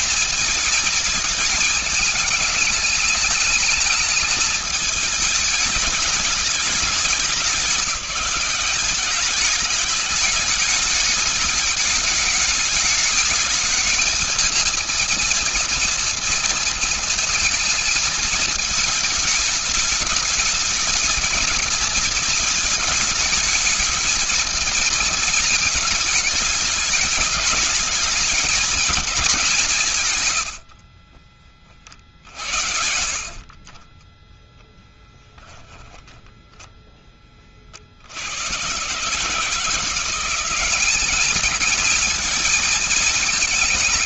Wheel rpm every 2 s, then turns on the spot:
220, 210, 220, 210, 200, 210, 210, 220, 230, 220, 220, 230, 220, 210, 220, 90, 70, 10, 0, 100, 180, 220.
30-34